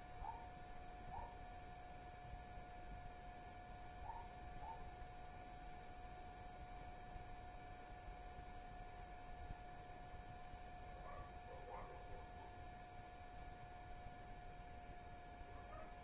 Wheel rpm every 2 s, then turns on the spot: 0, 0, 0, 0, 0, 0, 0, 0.
none